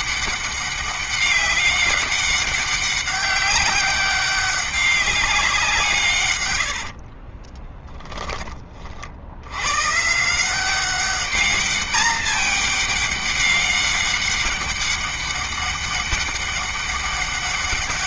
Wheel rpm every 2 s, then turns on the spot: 200, 200, 200, 100, 50, 190, 210, 200, 200.
6-8